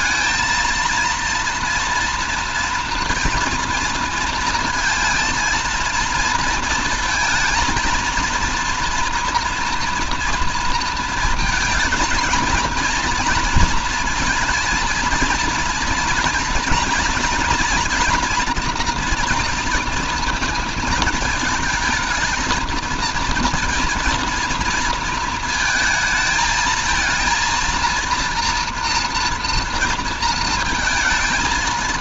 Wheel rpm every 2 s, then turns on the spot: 230, 230, 230, 230, 230, 230, 230, 230, 230, 230, 230, 230, 230, 220, 230, 220.
none